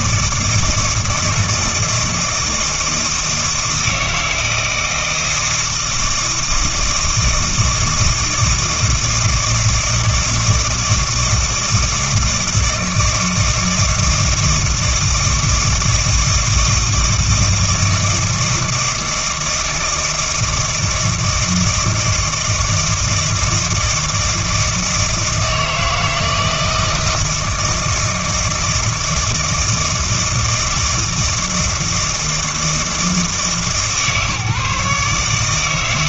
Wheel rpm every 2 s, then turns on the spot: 160, 160, 160, 160, 160, 160, 160, 160, 160, 160, 160, 160, 160, 160, 160, 160, 160, 150.
none